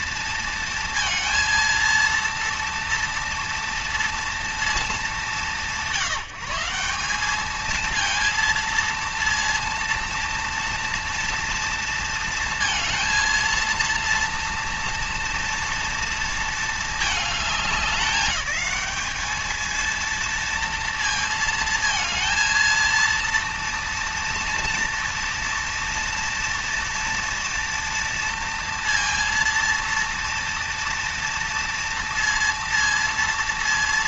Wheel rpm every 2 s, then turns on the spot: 230, 230, 210, 190, 230, 230, 230, 230, 220, 210, 230, 230, 230, 230, 230, 230, 230.
none